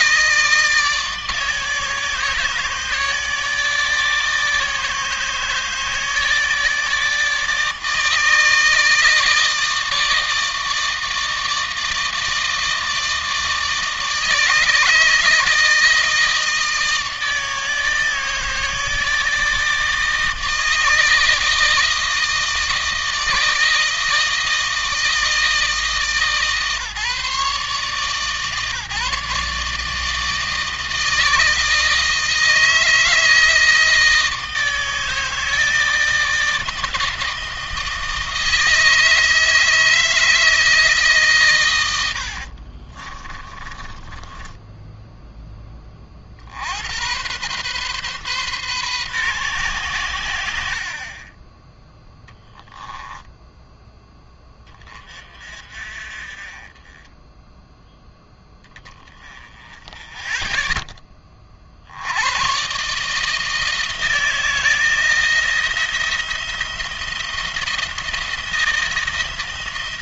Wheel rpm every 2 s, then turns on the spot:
160, 150, 160, 160, 160, 160, 160, 150, 160, 160, 160, 160, 160, 150, 150, 160, 160, 160, 160, 160, 150, 40, 10, 70, 130, 60, 10, 20, 30, 10, 10, 120, 160, 170, 170.
42-46